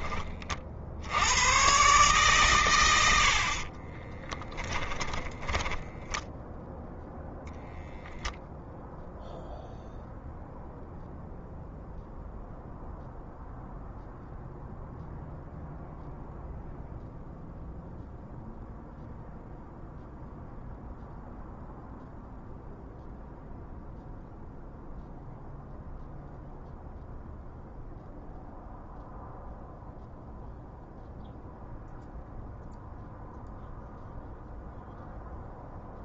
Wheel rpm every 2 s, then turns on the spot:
60, 110, 10, 0, 0, 0, 0, 0, 0, 0, 0, 0, 0, 0, 0, 0, 0, 0.
4-6